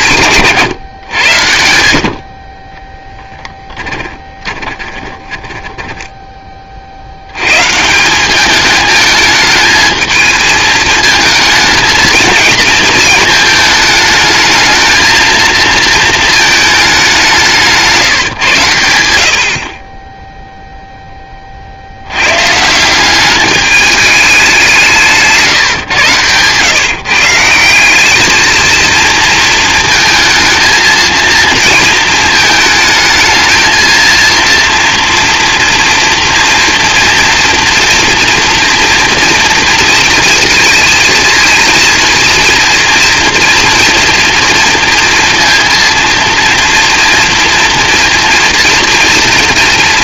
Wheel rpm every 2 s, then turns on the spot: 140, 30, 10, 50, 220, 220, 230, 220, 210, 100, 10, 200, 160, 150, 230, 230, 220, 230, 230, 230, 220, 230, 230, 230, 230.
4-6 24-26